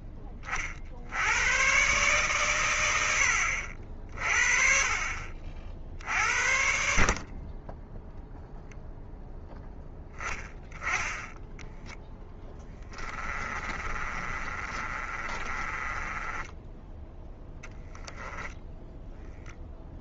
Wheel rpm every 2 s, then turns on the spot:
60, 100, 40, 50, 0, 10, 10, 30, 20, 10.
12-16